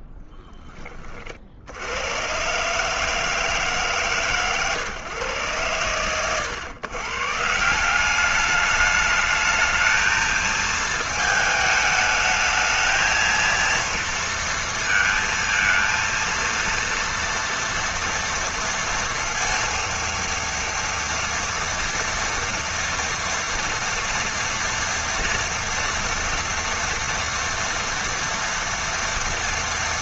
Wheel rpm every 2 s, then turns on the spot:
10, 140, 130, 110, 210, 220, 220, 230, 230, 230, 230, 230, 240, 230, 240.
none